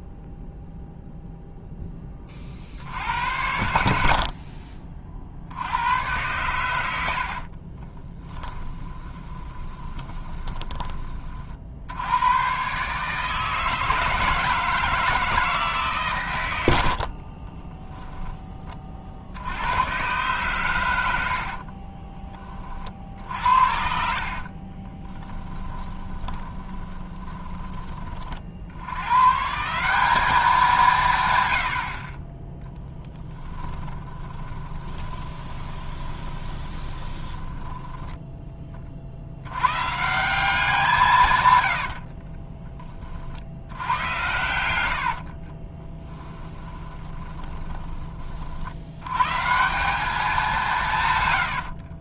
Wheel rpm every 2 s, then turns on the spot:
0, 50, 40, 100, 20, 20, 130, 160, 100, 30, 110, 30, 40, 20, 80, 180, 10, 20, 20, 30, 170, 20, 90, 20, 60, 160.
8-10 24-28 32-38 44-48